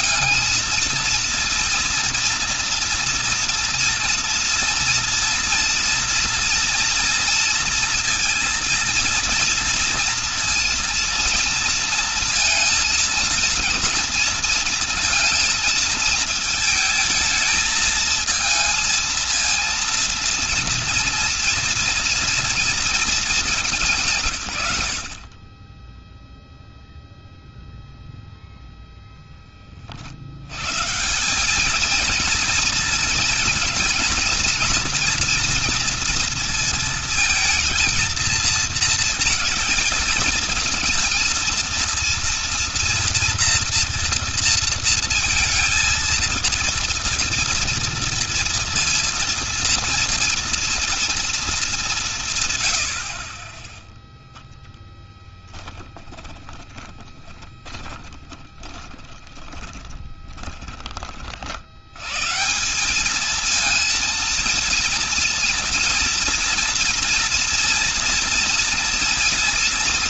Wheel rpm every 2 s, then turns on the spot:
220, 240, 230, 230, 230, 230, 230, 230, 220, 230, 230, 230, 120, 0, 0, 100, 230, 240, 230, 230, 220, 230, 230, 230, 230, 230, 130, 0, 30, 20, 20, 160, 230, 230, 240.
56-62